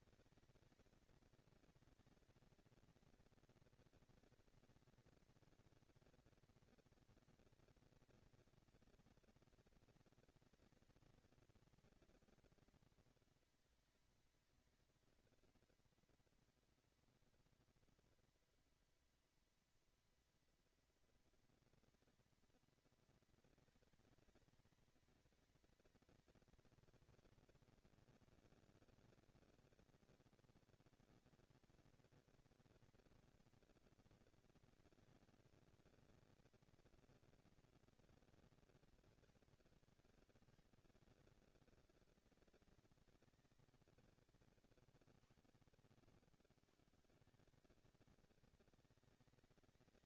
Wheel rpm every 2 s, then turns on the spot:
220, 230, 230, 230, 220, 230, 230, 230, 230, 230, 230, 230, 220, 230, 230, 240, 230, 230, 230, 230, 200, 200, 180, 130, 220.
none